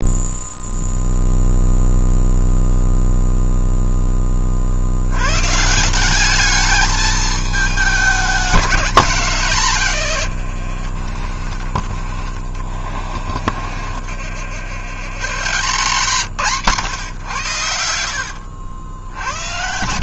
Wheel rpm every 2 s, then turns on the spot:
0, 0, 40, 210, 210, 90, 40, 80, 150, 70.
none